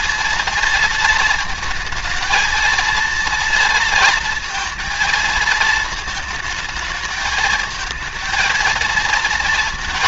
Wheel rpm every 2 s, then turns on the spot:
230, 230, 230, 220, 220.
none